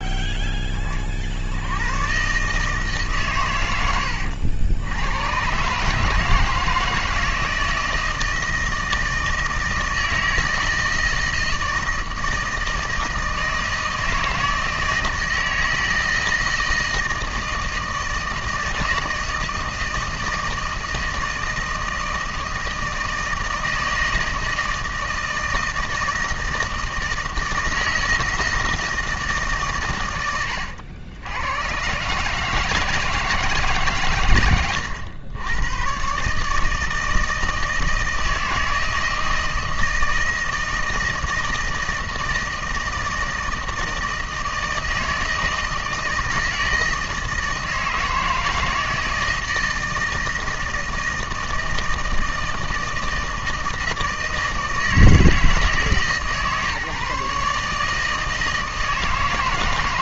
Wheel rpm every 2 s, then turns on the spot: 10, 150, 80, 160, 160, 160, 160, 160, 160, 160, 160, 160, 160, 160, 160, 100, 160, 110, 150, 160, 160, 160, 160, 170, 160, 160, 160, 160, 150, 160.
30-32 34-36